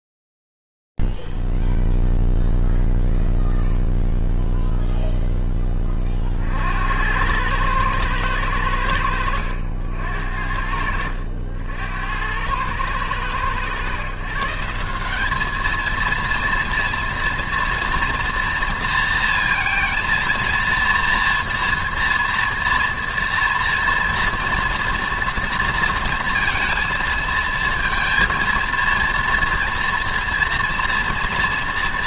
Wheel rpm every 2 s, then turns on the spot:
0, 0, 0, 40, 110, 60, 80, 150, 230, 230, 230, 230, 240, 230, 230, 230.
none